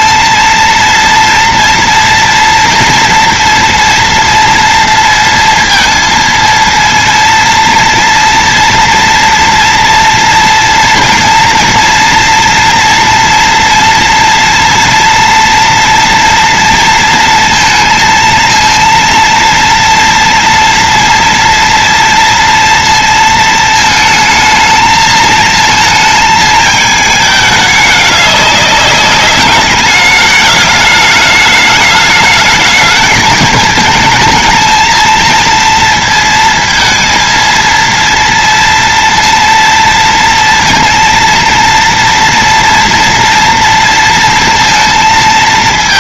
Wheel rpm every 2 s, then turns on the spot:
230, 230, 230, 230, 230, 230, 230, 230, 230, 230, 230, 230, 220, 220, 200, 210, 210, 230, 220, 230, 230, 240, 230.
none